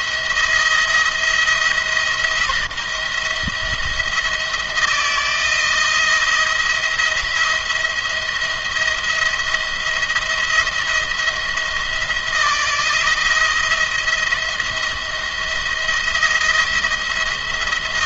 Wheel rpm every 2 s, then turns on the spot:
170, 170, 170, 170, 170, 170, 170, 170, 170.
none